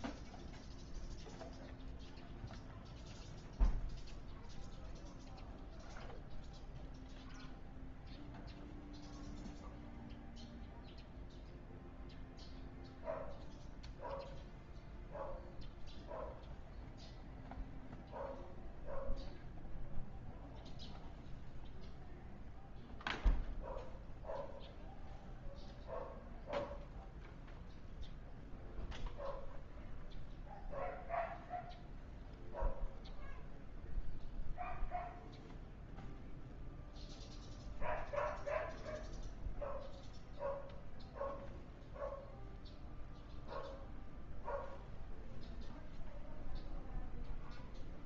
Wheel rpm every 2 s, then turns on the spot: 0, 0, 0, 0, 0, 0, 0, 0, 0, 0, 0, 0, 0, 0, 0, 0, 0, 0, 0, 0, 0, 0, 0, 0.
none